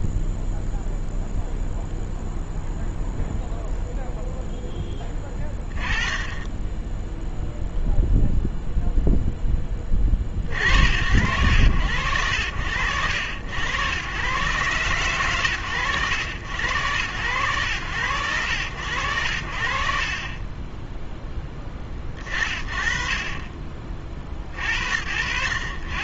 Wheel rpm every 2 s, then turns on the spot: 0, 0, 0, 10, 0, 40, 80, 120, 90, 80, 20, 50, 40.
none